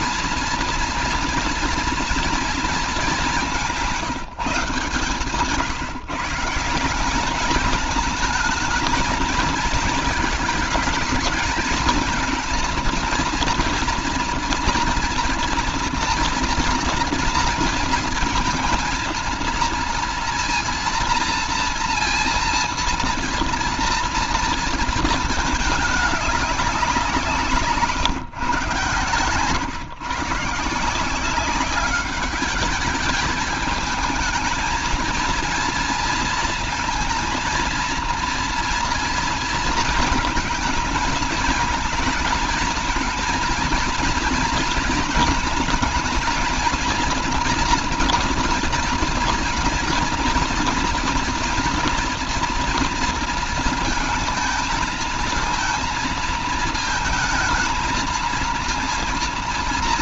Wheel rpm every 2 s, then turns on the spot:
230, 200, 140, 200, 220, 220, 230, 240, 230, 230, 230, 230, 230, 170, 110, 170, 210, 230, 230, 230, 220, 230, 230, 240, 230, 230, 230, 220, 220, 230.
none